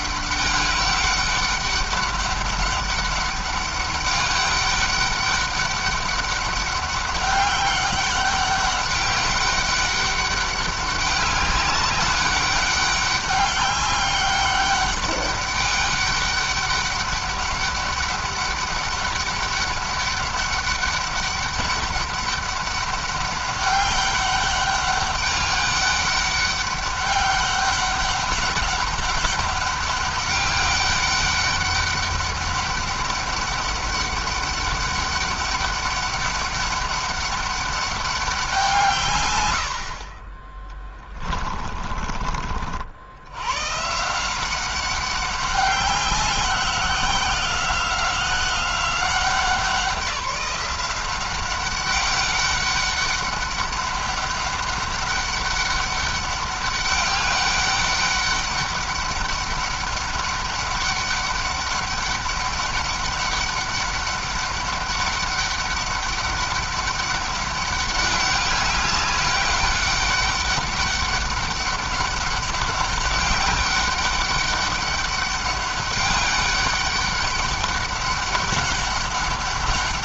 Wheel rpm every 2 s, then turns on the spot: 200, 200, 200, 200, 200, 200, 200, 200, 200, 190, 200, 200, 200, 200, 200, 200, 200, 200, 200, 160, 20, 60, 190, 190, 180, 190, 200, 200, 200, 200, 200, 200, 200, 200, 200, 200, 200, 200, 200, 200.
40-42